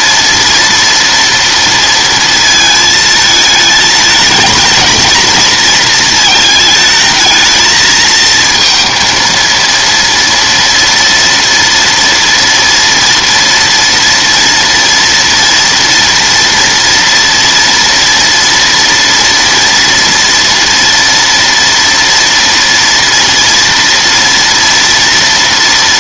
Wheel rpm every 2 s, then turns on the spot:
240, 220, 220, 220, 230, 230, 230, 230, 230, 230, 230, 240, 230.
none